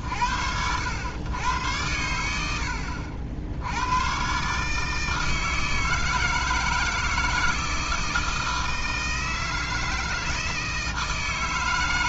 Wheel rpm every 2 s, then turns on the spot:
50, 80, 110, 160, 160, 160.
none